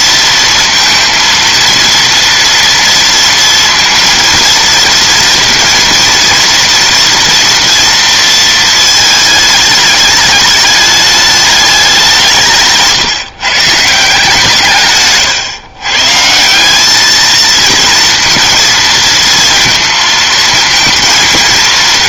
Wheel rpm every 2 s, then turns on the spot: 230, 230, 230, 230, 220, 210, 180, 150, 190, 230, 220.
12-14